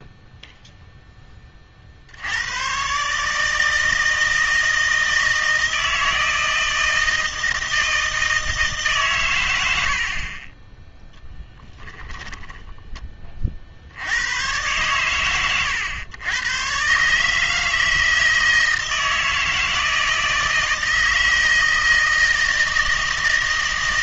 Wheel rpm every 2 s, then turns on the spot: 0, 120, 160, 160, 150, 20, 20, 120, 120, 160, 160, 160.
12-14